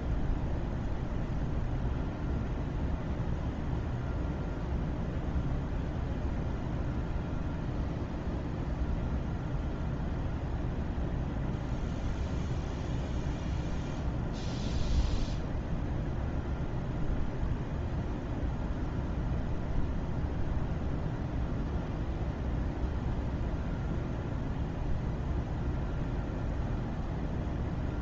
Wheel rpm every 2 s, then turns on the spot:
0, 0, 0, 0, 0, 0, 0, 0, 0, 0, 0, 0, 0, 0.
none